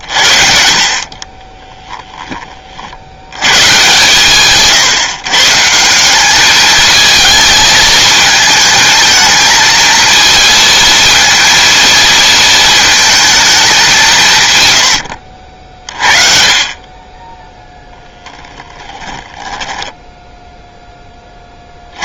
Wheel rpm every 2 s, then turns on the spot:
50, 50, 140, 210, 220, 230, 230, 110, 30, 10, 10.
18-20